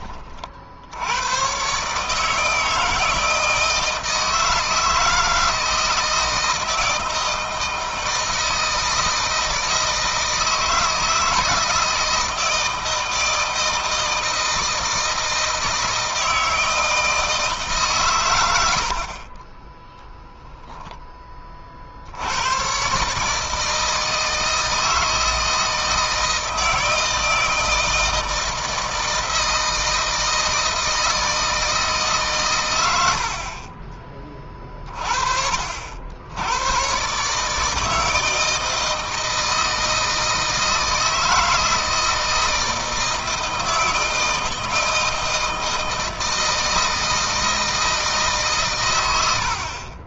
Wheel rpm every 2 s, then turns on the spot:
70, 160, 160, 160, 160, 160, 160, 160, 160, 100, 0, 120, 160, 160, 160, 160, 100, 30, 110, 160, 160, 160, 160, 160, 130.
none